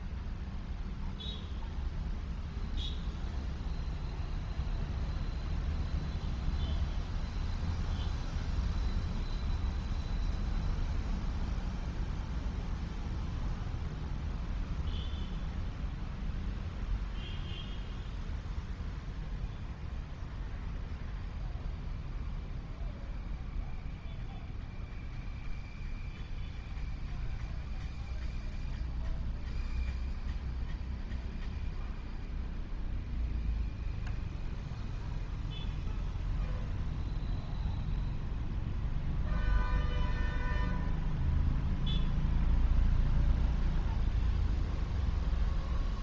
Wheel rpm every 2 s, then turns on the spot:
0, 0, 0, 0, 0, 0, 0, 0, 0, 0, 0, 0, 0, 0, 0, 0, 0, 0, 0, 0, 0, 0, 0.
none